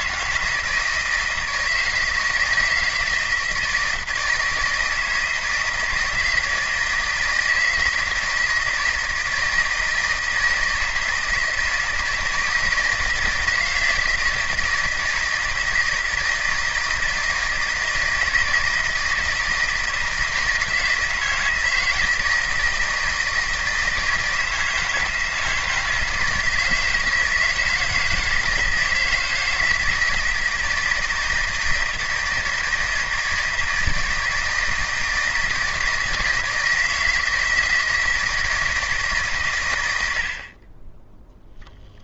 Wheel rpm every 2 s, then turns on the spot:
160, 160, 160, 160, 160, 160, 160, 160, 160, 160, 160, 160, 160, 160, 160, 160, 160, 160, 160, 160, 10.
40-42